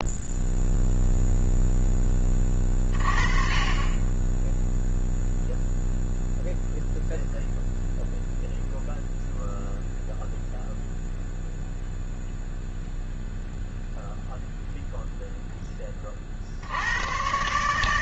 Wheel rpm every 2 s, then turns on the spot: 0, 30, 0, 0, 0, 0, 0, 0, 70.
none